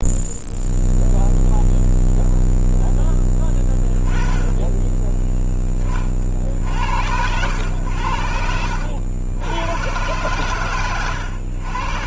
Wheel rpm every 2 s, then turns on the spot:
0, 0, 10, 80, 80, 120.
none